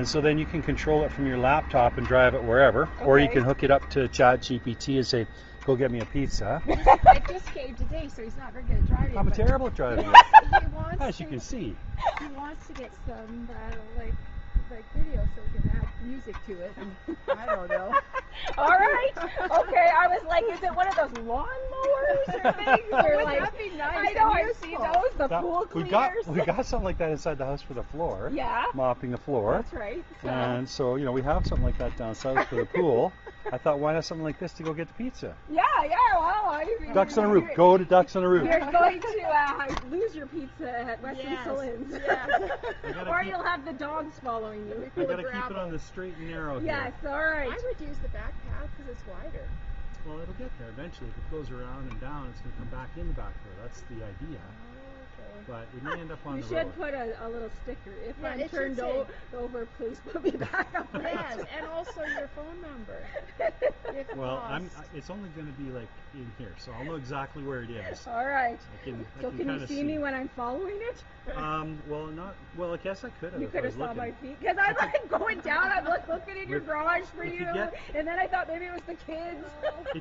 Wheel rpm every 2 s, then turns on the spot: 0, 0, 0, 0, 0, 0, 0, 0, 0, 0, 0, 0, 0, 0, 0, 0, 0, 0, 0, 0, 0, 0, 0, 0, 0, 0, 0, 0, 0, 0, 0, 0, 0, 0, 0, 0, 0, 0, 0, 0.
none